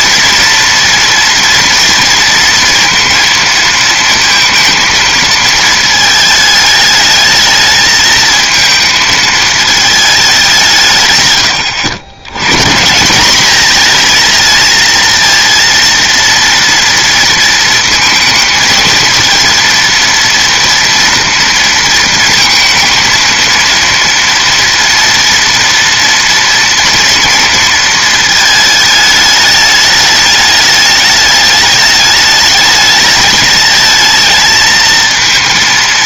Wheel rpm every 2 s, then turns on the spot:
230, 230, 230, 210, 220, 150, 160, 230, 230, 220, 230, 220, 230, 230, 220, 210, 210, 220.
none